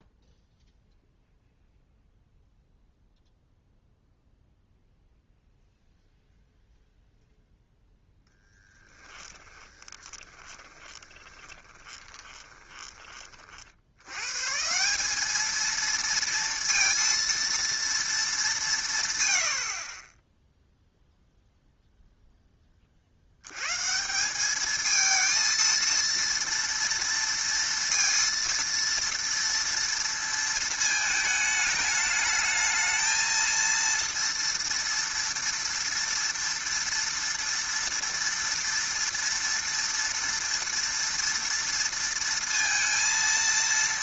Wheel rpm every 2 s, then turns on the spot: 0, 0, 0, 0, 10, 30, 20, 140, 230, 210, 10, 10, 200, 230, 230, 220, 220, 230, 240, 230, 230, 230.
8-14